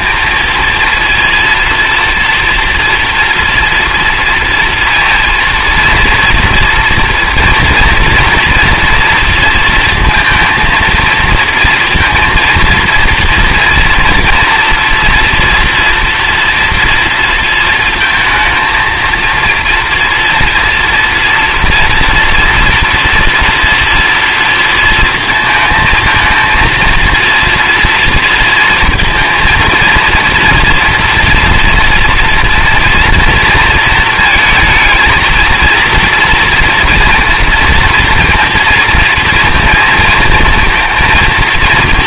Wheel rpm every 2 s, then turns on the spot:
230, 230, 230, 230, 240, 230, 230, 230, 230, 220, 240, 240, 230, 230, 230, 230, 230, 220, 240, 230, 230.
none